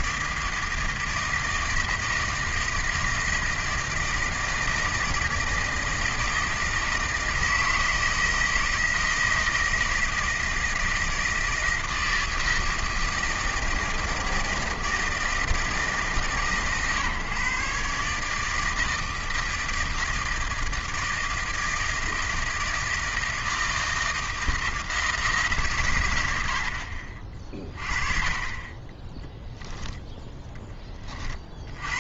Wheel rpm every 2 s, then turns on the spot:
160, 160, 160, 160, 160, 160, 160, 160, 140, 160, 160, 160, 160, 50, 20, 20.
none